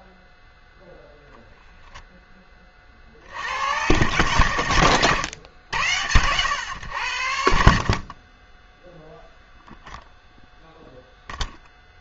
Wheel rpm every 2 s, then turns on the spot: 0, 40, 110, 90, 0, 0.
none